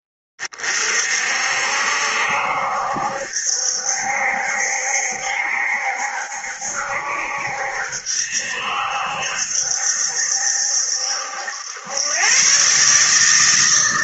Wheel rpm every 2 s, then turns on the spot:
30, 70, 70, 70, 70, 70, 140.
none